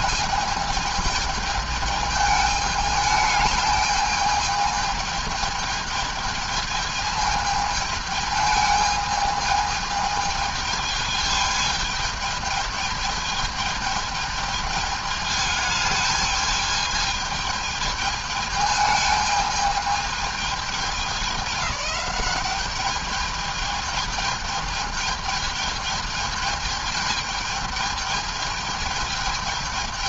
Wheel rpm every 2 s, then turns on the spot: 220, 210, 220, 220, 210, 210, 210, 210, 220, 210, 210, 200, 210, 210, 220.
none